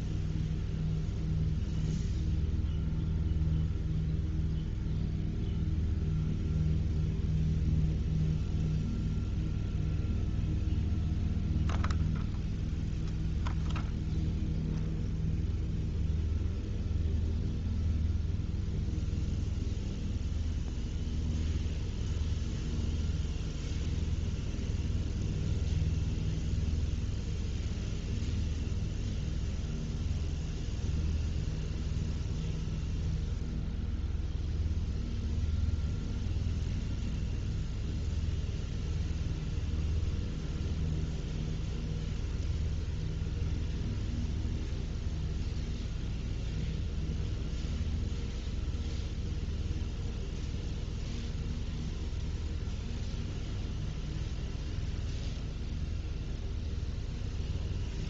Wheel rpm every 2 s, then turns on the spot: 0, 0, 0, 0, 0, 0, 0, 0, 0, 0, 0, 0, 0, 0, 0, 0, 0, 0, 0, 0, 0, 0, 0, 0, 0, 0, 0, 0, 0.
none